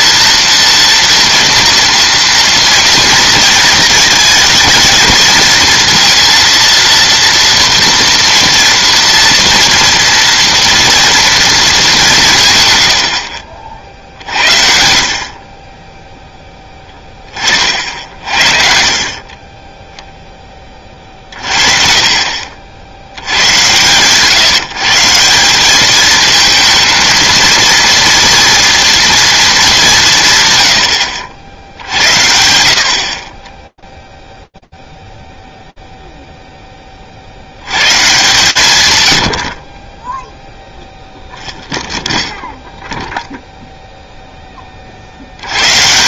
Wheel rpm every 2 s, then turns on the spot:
230, 230, 230, 230, 230, 230, 110, 60, 10, 50, 20, 70, 160, 220, 230, 120, 60, 0, 50, 90, 0, 0, 50.
18-20